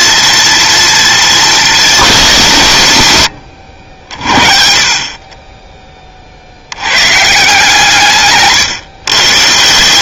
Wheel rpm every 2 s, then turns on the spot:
230, 120, 40, 100, 130.
none